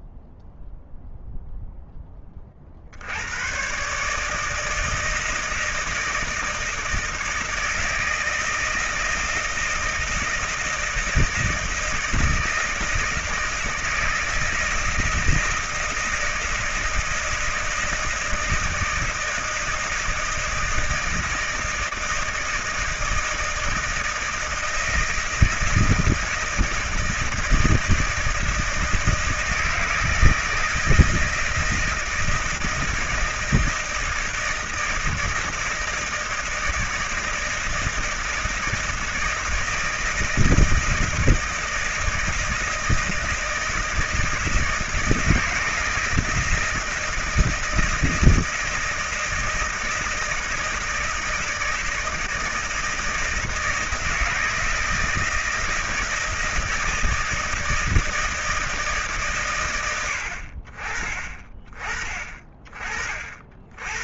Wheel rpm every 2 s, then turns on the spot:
0, 60, 160, 160, 160, 160, 160, 160, 160, 160, 160, 160, 160, 170, 160, 160, 160, 160, 160, 160, 160, 160, 160, 160, 170, 160, 160, 160, 160, 150, 30, 30.
none